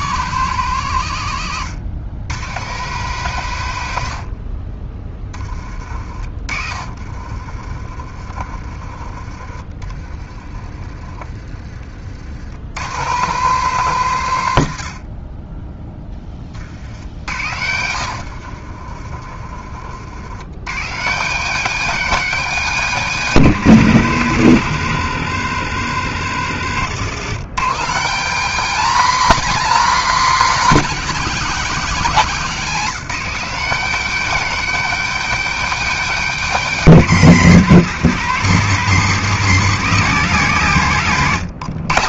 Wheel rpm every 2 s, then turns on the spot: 130, 130, 40, 40, 40, 50, 110, 110, 40, 50, 110, 180, 100, 80, 210, 230, 190, 260, 230, 200, 170.
6-12 18-20 26-28